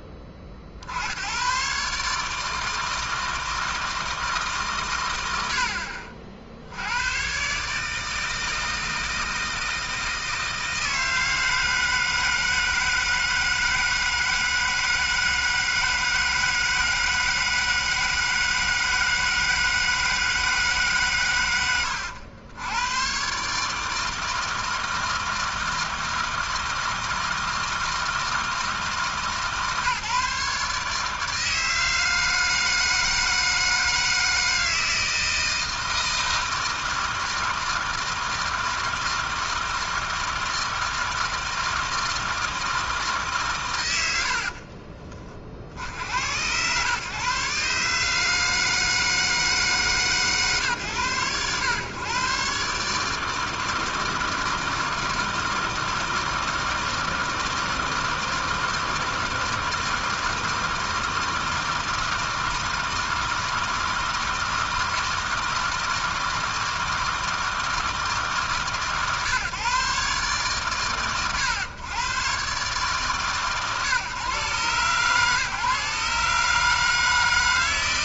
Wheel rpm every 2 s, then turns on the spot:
80, 160, 140, 90, 160, 160, 160, 160, 160, 160, 150, 110, 160, 160, 150, 150, 160, 160, 160, 160, 160, 160, 50, 130, 160, 110, 150, 160, 160, 160, 160, 160, 160, 160, 130, 120, 130, 120, 150.
44-46